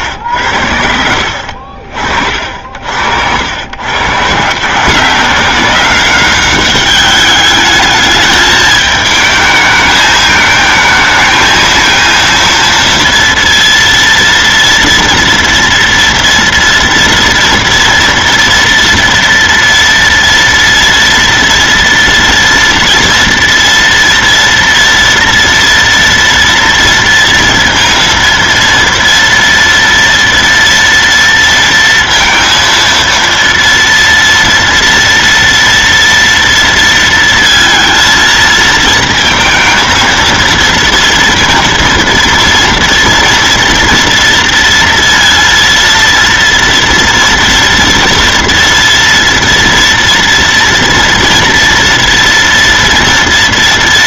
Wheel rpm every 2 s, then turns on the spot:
80, 60, 150, 200, 220, 220, 230, 230, 240, 230, 230, 230, 230, 230, 230, 230, 230, 230, 230, 220, 230, 230, 230, 230, 230, 230, 240.
none